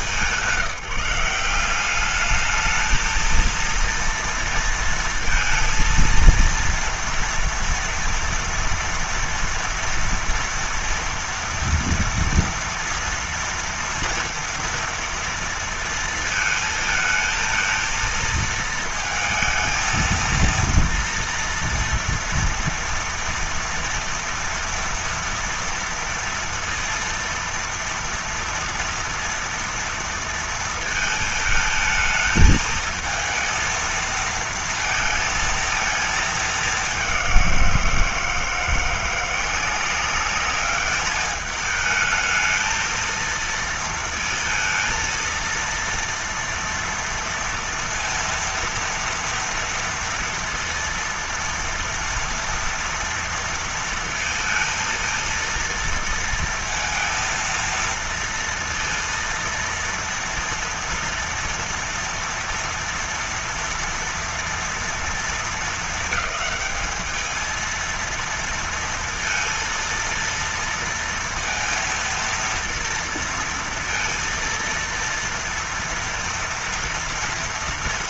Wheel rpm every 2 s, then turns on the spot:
180, 220, 230, 230, 230, 230, 230, 230, 220, 230, 230, 230, 230, 230, 230, 230, 220, 220, 200, 170, 210, 230, 230, 230, 230, 230, 230, 230, 230, 230, 230, 230, 230, 220, 230, 230, 230, 230, 230.
none